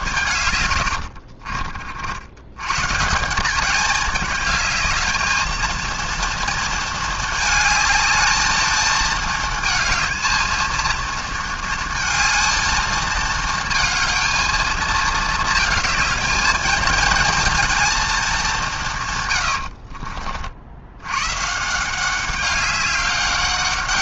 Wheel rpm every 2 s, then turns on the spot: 100, 120, 210, 230, 220, 230, 220, 220, 220, 180, 80, 200.
0-2